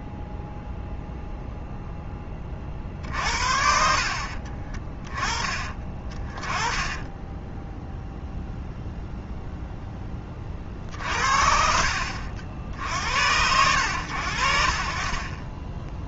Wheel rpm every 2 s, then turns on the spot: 0, 40, 30, 10, 0, 40, 70, 50.
4-8